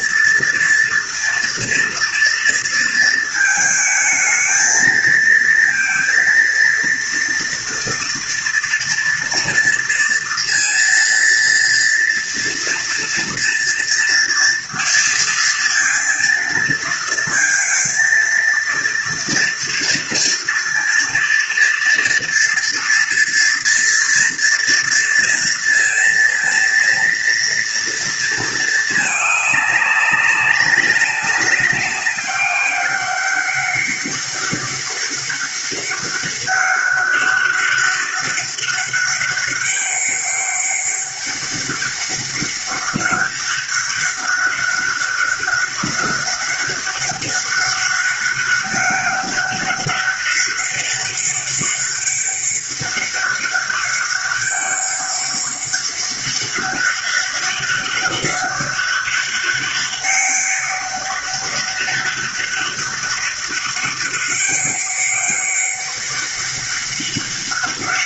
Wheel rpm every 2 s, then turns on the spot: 230, 220, 220, 230, 230, 230, 230, 230, 230, 230, 230, 230, 230, 230, 210, 190, 200, 200, 200, 200, 200, 200, 200, 200, 200, 200, 200, 200, 200, 200, 200, 200, 200, 200.
none